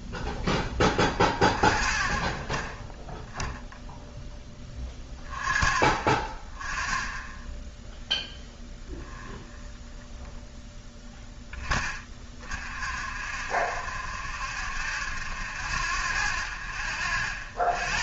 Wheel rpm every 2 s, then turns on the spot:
0, 0, 0, 0, 0, 0, 0, 0, 0.
none